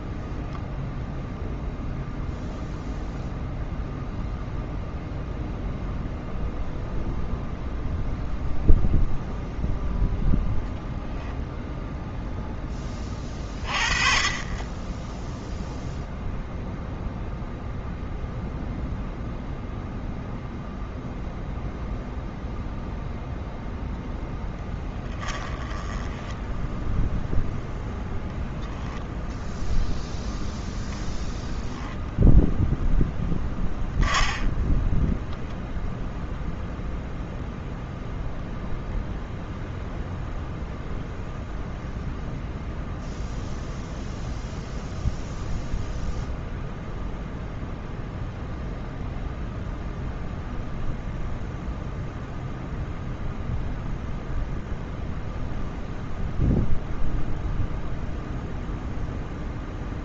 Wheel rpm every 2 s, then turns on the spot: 0, 0, 0, 0, 0, 0, 10, 20, 0, 0, 0, 0, 10, 10, 0, 0, 0, 10, 0, 0, 0, 0, 0, 0, 0, 0, 0, 0, 0, 0.
24-26